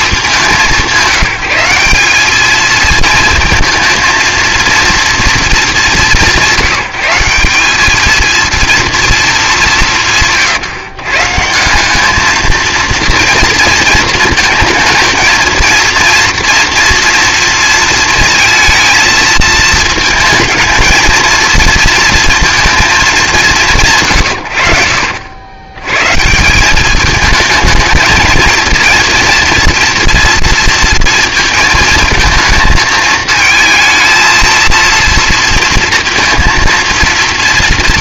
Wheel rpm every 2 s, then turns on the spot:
190, 220, 230, 180, 230, 140, 220, 220, 230, 220, 230, 220, 70, 190, 230, 230, 220, 230, 230.
none